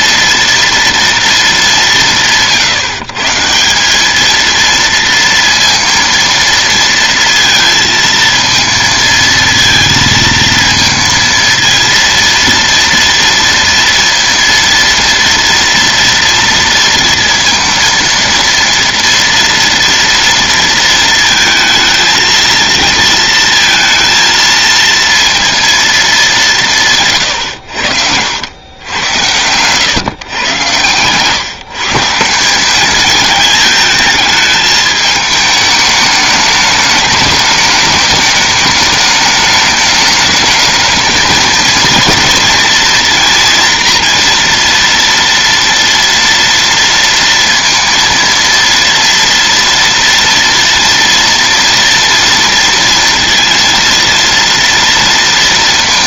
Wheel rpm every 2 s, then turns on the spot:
230, 140, 230, 230, 230, 220, 230, 230, 230, 230, 230, 230, 230, 160, 90, 110, 200, 220, 210, 210, 220, 230, 230, 230, 230, 230, 230, 230.
none